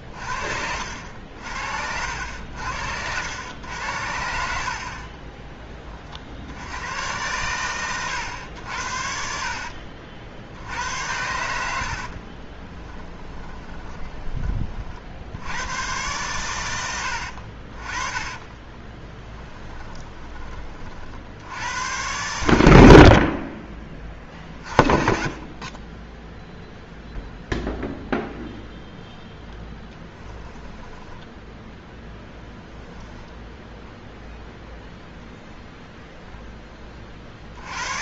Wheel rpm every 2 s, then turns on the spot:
70, 80, 60, 90, 80, 80, 20, 30, 100, 40, 30, 90, 40, 0, 0, 10, 0, 0, 20.
4-6 12-14 18-20 24-26 30-32